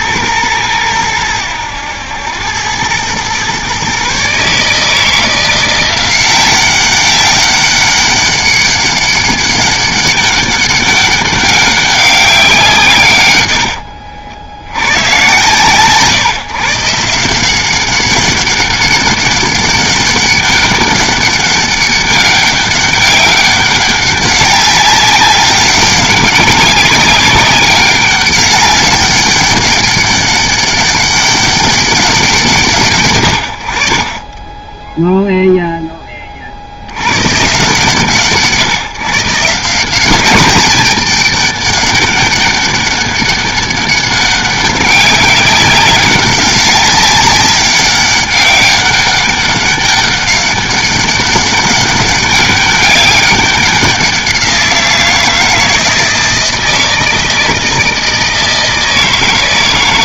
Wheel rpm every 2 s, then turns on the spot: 110, 100, 150, 190, 200, 200, 170, 80, 140, 200, 200, 200, 190, 200, 200, 200, 160, 10, 60, 150, 210, 200, 190, 190, 200, 200, 200, 180, 160, 160.
none